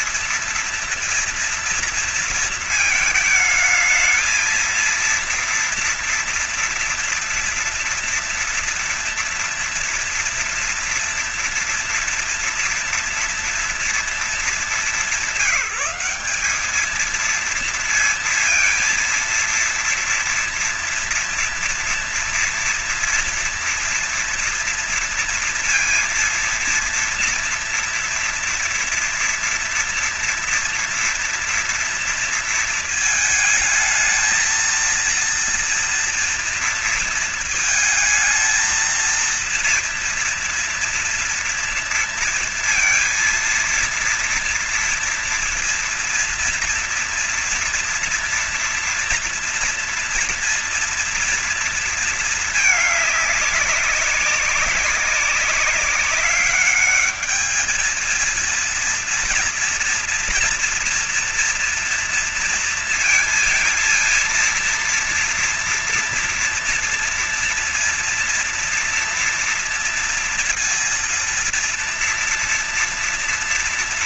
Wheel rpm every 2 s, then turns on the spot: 230, 220, 220, 230, 230, 240, 240, 210, 200, 230, 230, 230, 230, 230, 230, 230, 230, 220, 230, 220, 230, 230, 230, 230, 230, 230, 220, 200, 200, 230, 230, 230, 230, 230, 230, 230, 230.
none